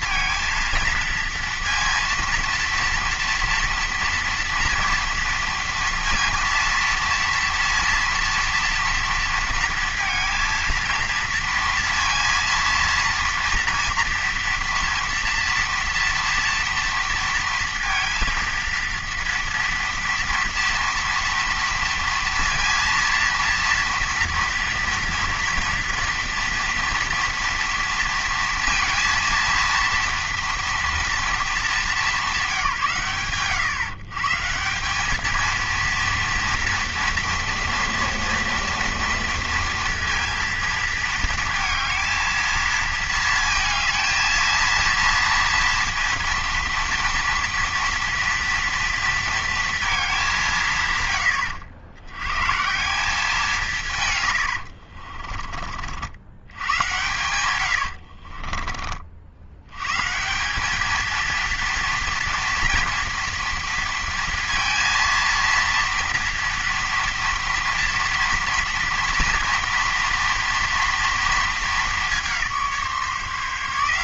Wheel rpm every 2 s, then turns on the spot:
230, 230, 230, 230, 230, 230, 230, 230, 230, 230, 230, 230, 230, 230, 230, 230, 170, 170, 240, 230, 230, 230, 230, 230, 230, 150, 150, 80, 100, 30, 190, 230, 230, 230, 230, 230, 170.
54-56 58-60